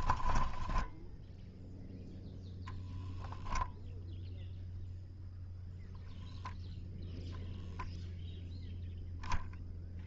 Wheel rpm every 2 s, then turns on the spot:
10, 0, 0, 0, 0.
0-2